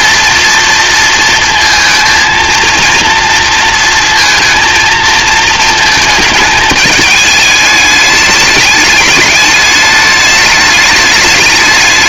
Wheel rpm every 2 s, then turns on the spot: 230, 230, 230, 220, 210, 210.
none